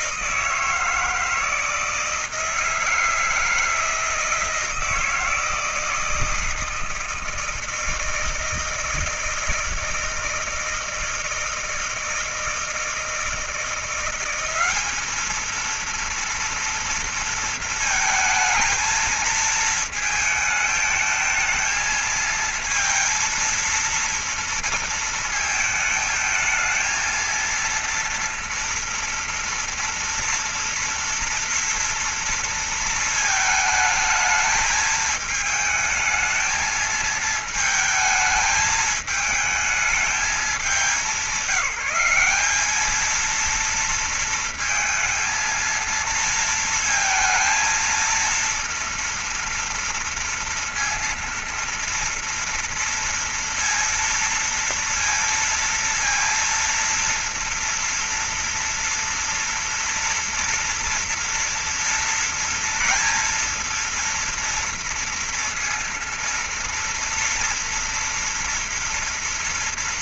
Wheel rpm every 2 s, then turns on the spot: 160, 160, 160, 160, 160, 160, 160, 190, 230, 220, 220, 230, 230, 220, 230, 230, 230, 220, 220, 220, 220, 210, 230, 230, 230, 230, 230, 230, 230, 230, 230, 230, 230, 230, 240.
none